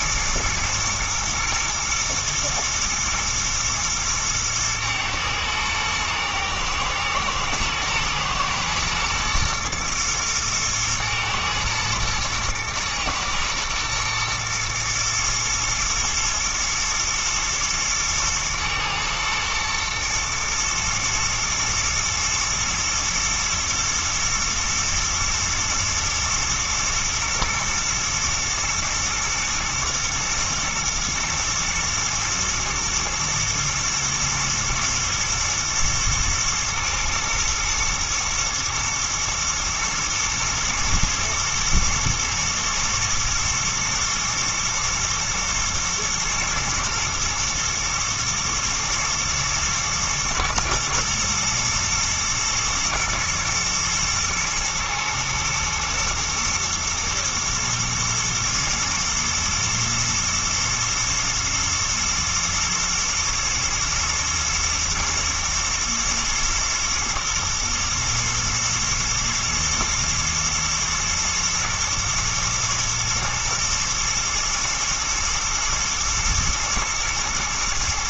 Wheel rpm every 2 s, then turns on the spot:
120, 120, 110, 110, 120, 120, 120, 120, 120, 110, 110, 110, 110, 110, 120, 110, 120, 110, 110, 120, 110, 120, 110, 110, 110, 110, 120, 110, 120, 120, 110, 120, 120, 110, 110, 120, 120, 120, 110.
none